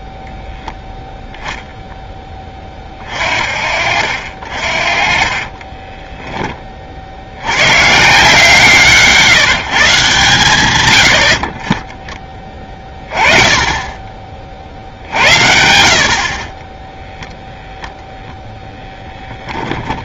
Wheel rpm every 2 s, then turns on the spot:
20, 50, 20, 160, 70, 20, 40, 10, 10, 0.
16-18